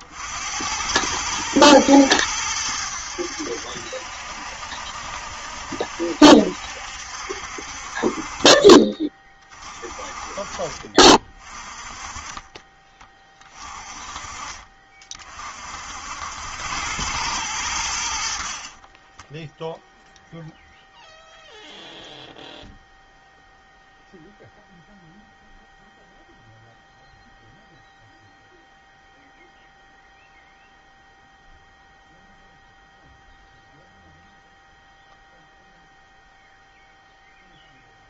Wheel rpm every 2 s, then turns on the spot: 90, 90, 60, 70, 40, 30, 20, 40, 90, 40, 0, 0, 0, 0, 0, 0, 0, 0, 0.
18-20